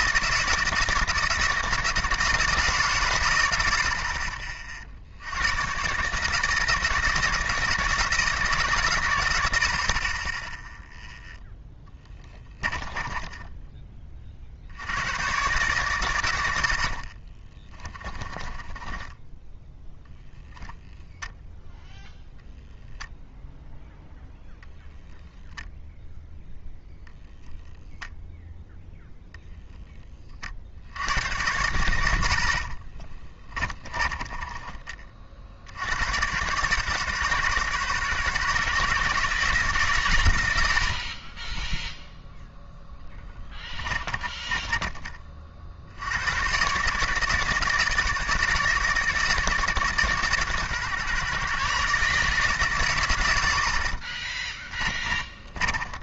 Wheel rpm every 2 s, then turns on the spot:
160, 150, 50, 160, 140, 0, 10, 70, 80, 20, 0, 0, 0, 0, 0, 70, 50, 20, 120, 140, 90, 0, 20, 120, 150, 130, 150, 20.
12-14 16-20 32-36 44-46 54-56